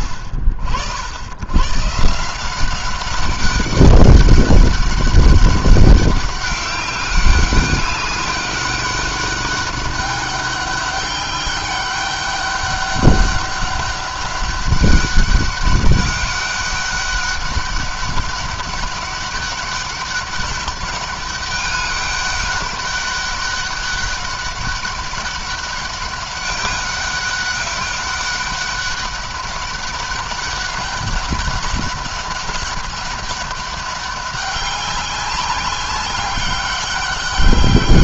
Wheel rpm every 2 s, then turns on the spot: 50, 180, 200, 190, 200, 200, 200, 200, 200, 200, 200, 200, 200, 200, 200, 200, 200, 190, 200.
none